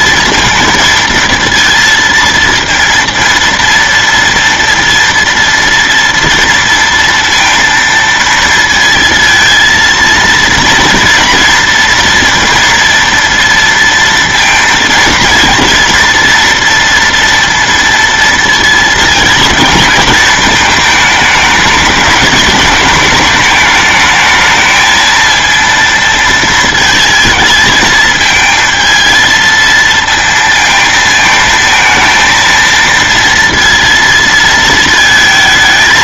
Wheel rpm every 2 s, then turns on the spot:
230, 230, 230, 230, 230, 230, 230, 230, 230, 220, 220, 220, 220, 230, 230, 220, 230, 220.
none